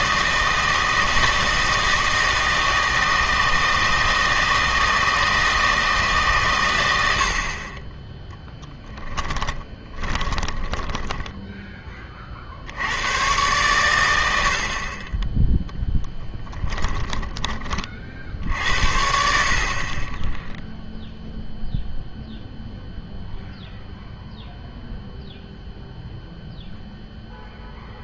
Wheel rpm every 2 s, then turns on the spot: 160, 160, 160, 120, 10, 20, 60, 60, 20, 60, 0, 0, 0, 0.
8-12 16-18